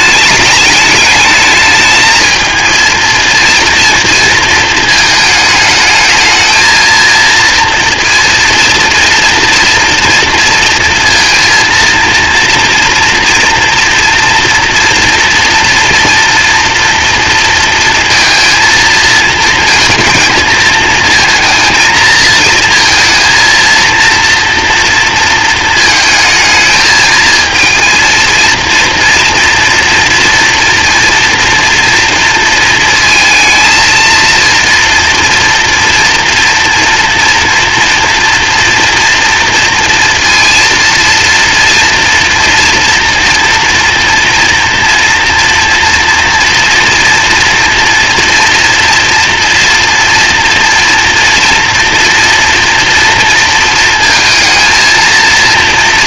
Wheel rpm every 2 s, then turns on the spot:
210, 230, 220, 230, 230, 230, 230, 230, 230, 220, 220, 230, 230, 220, 230, 230, 220, 230, 230, 230, 230, 230, 230, 230, 240, 240, 230, 230.
none